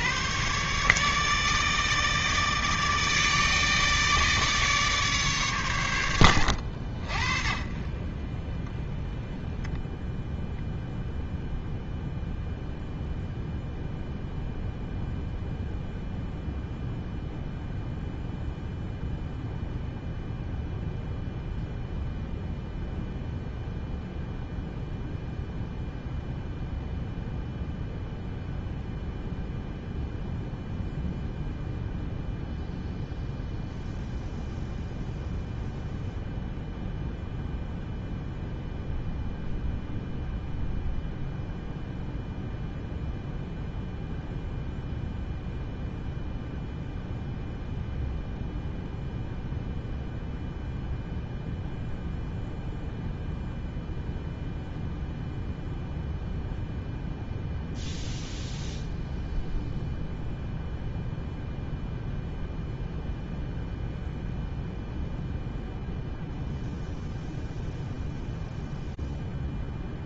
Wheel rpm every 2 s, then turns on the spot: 140, 160, 150, 70, 10, 0, 0, 0, 0, 0, 0, 0, 0, 0, 0, 0, 0, 0, 0, 0, 0, 0, 0, 0, 0, 0, 0, 0, 0, 0, 0, 0, 0, 0, 0.
none